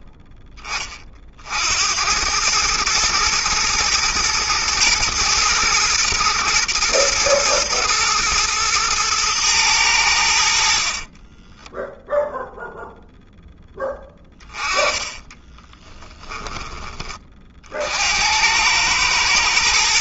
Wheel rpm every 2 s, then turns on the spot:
20, 110, 110, 120, 110, 40, 0, 20, 20, 100.
14-16